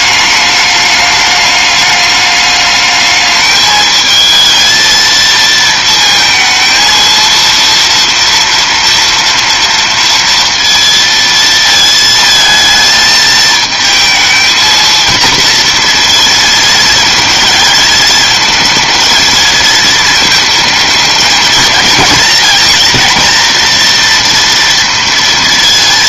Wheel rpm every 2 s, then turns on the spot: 210, 210, 220, 230, 230, 230, 220, 230, 220, 220, 220, 230, 230.
none